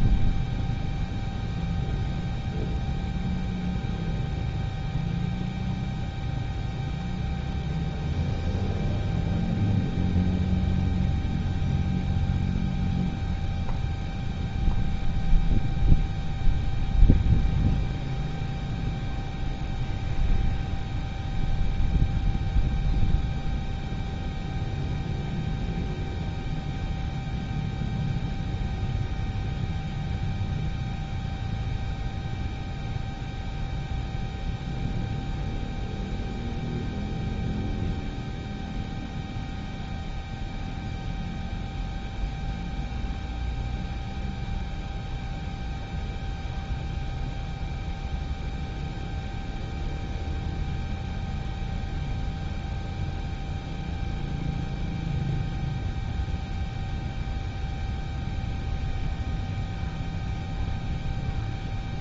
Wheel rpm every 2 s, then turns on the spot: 0, 0, 0, 0, 0, 0, 0, 0, 0, 0, 0, 0, 0, 0, 0, 0, 0, 0, 0, 0, 0, 0, 0, 0, 0, 0, 0, 0, 0, 0, 0.
none